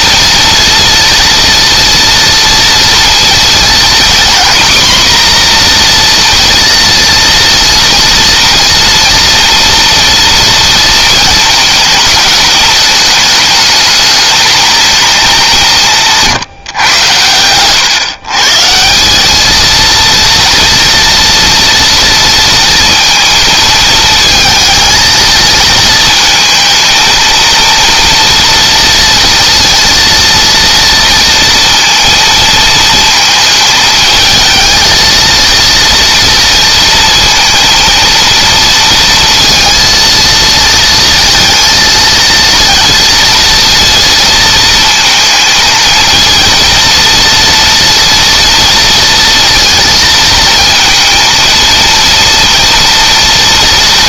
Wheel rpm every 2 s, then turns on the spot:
230, 230, 240, 230, 230, 230, 210, 210, 110, 190, 230, 230, 220, 230, 230, 230, 220, 230, 230, 230, 230, 230, 220, 230, 230, 230, 230.
none